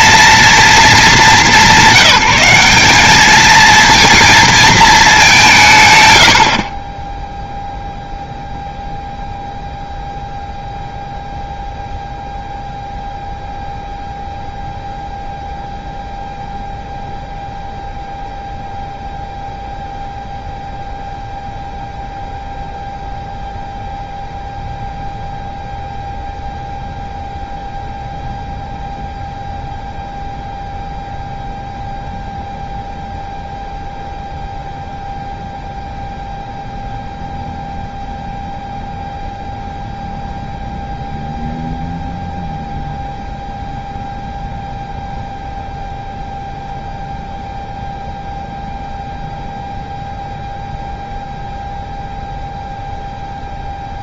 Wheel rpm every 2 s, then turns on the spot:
220, 190, 220, 50, 0, 0, 0, 0, 0, 0, 0, 0, 0, 0, 0, 0, 0, 0, 0, 0, 0, 0, 0, 0, 0, 0, 0.
none